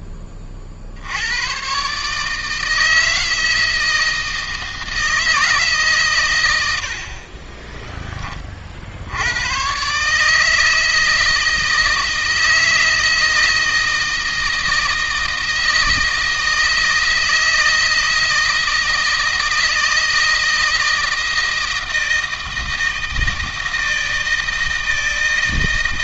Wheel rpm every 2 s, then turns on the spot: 70, 160, 160, 60, 80, 160, 160, 160, 160, 160, 160, 160, 160.
none